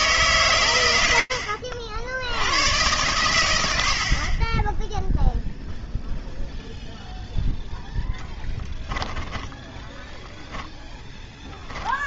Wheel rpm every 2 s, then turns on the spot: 70, 30, 0, 10, 10, 0.
2-4 8-10